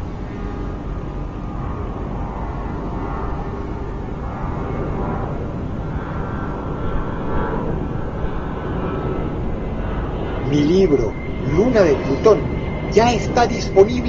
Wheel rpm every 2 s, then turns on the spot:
0, 0, 0, 0, 0, 0, 0.
none